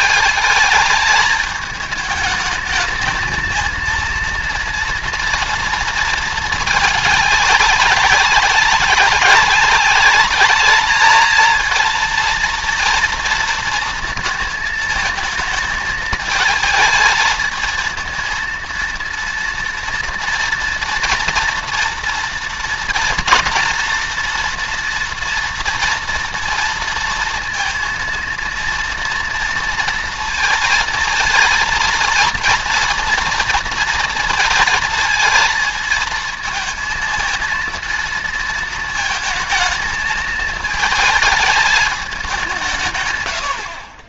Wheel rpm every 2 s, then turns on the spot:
210, 220, 230, 210, 190, 210, 230, 220, 220, 230, 230, 230, 230, 230, 230, 230, 230, 230, 230, 220, 220, 150.
none